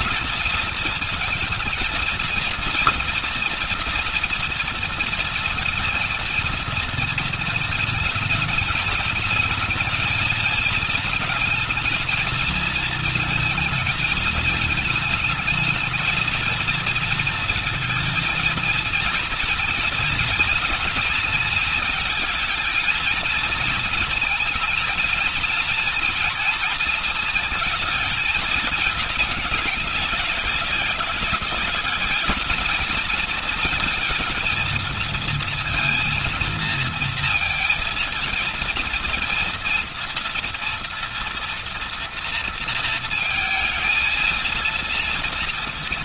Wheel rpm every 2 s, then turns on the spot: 220, 230, 230, 230, 220, 220, 230, 220, 230, 230, 230, 230, 220, 230, 220, 200, 220, 230, 230, 230, 230, 230, 230.
none